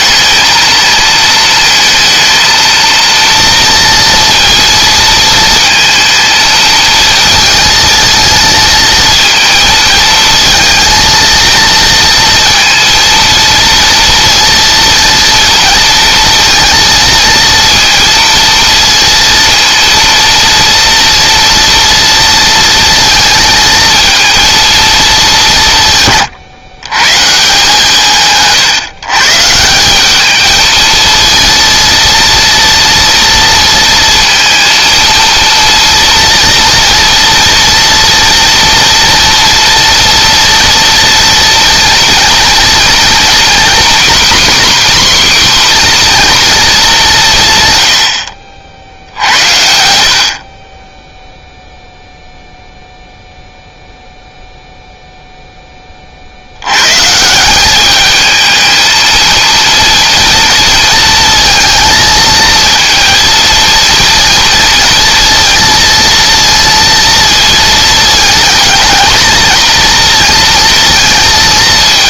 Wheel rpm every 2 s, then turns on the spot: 230, 230, 230, 230, 230, 230, 230, 230, 230, 230, 230, 230, 210, 130, 140, 220, 230, 230, 230, 230, 230, 230, 270, 190, 70, 10, 0, 0, 140, 220, 230, 230, 230, 230, 220, 230.
none